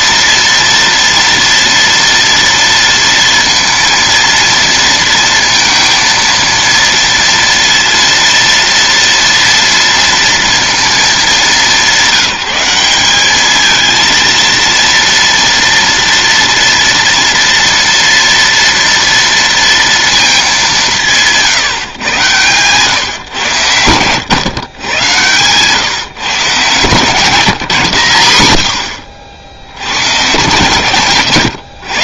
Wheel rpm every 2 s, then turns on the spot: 230, 230, 230, 230, 230, 230, 180, 230, 230, 230, 190, 130, 110, 140, 80, 130.
none